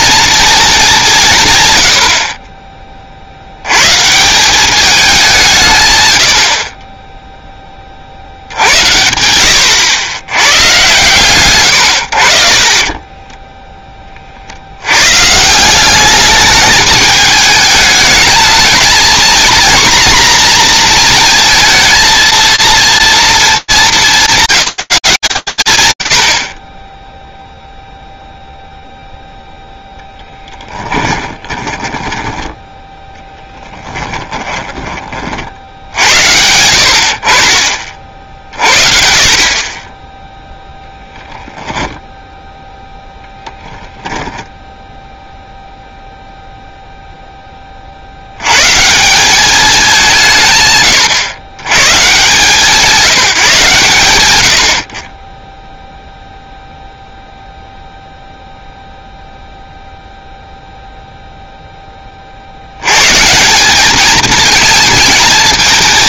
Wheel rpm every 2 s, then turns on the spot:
210, 20, 190, 40, 80, 120, 40, 70, 210, 220, 240, 230, 190, 50, 0, 20, 10, 30, 70, 40, 0, 0, 0, 0, 160, 140, 180, 40, 0, 0, 0, 70, 220.
12-14 30-32